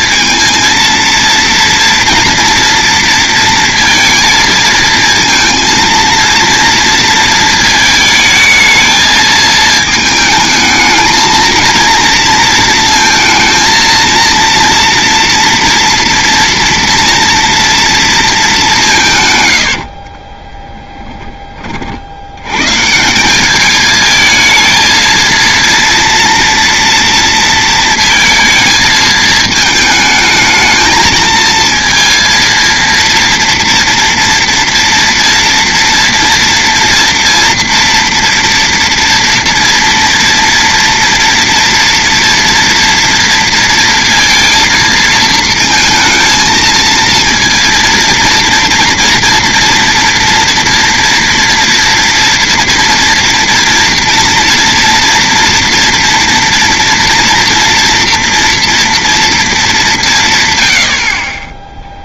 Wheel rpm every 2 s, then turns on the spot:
230, 230, 230, 230, 220, 220, 230, 230, 230, 200, 10, 120, 220, 230, 220, 220, 230, 230, 230, 230, 230, 230, 230, 220, 230, 230, 230, 240, 230, 230, 100.
20-22